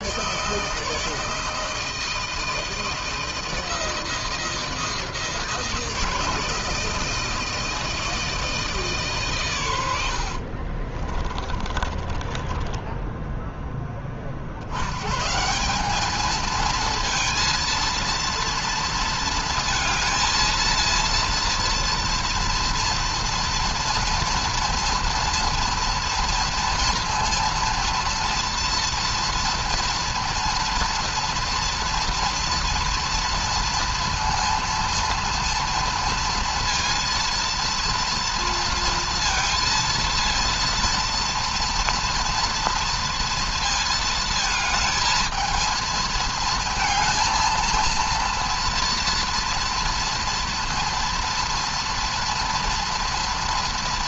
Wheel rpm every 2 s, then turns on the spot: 150, 160, 160, 160, 160, 50, 20, 60, 220, 230, 220, 230, 230, 230, 230, 230, 230, 230, 230, 230, 230, 230, 220, 230, 230, 230, 230.
10-14